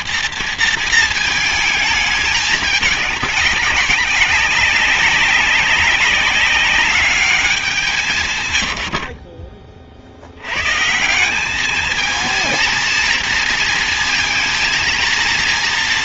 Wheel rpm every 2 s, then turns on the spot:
230, 210, 190, 200, 80, 130, 230, 230.
none